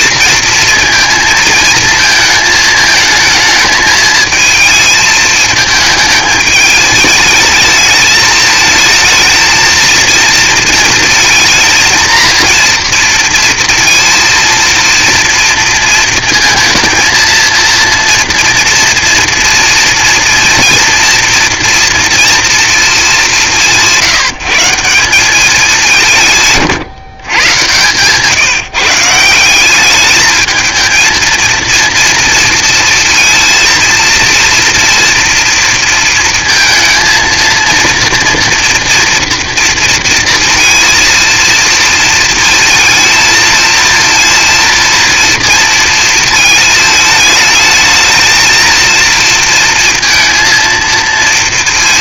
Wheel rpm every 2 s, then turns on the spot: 230, 220, 220, 210, 220, 230, 230, 230, 230, 240, 230, 230, 170, 140, 150, 220, 230, 230, 230, 240, 230, 230, 230, 220, 230, 230.
none